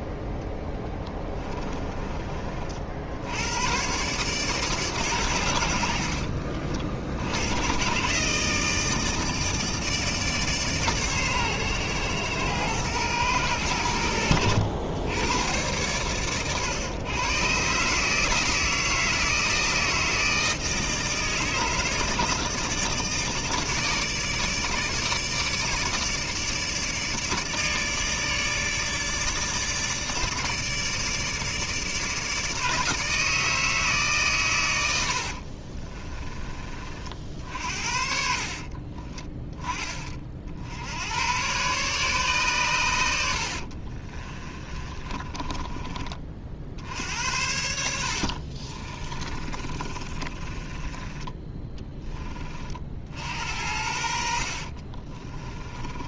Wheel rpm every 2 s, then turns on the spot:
10, 40, 140, 50, 140, 150, 120, 90, 110, 160, 160, 150, 160, 150, 150, 150, 150, 110, 30, 50, 60, 130, 30, 60, 50, 20, 30, 50.
38-40 44-46 48-52 54-56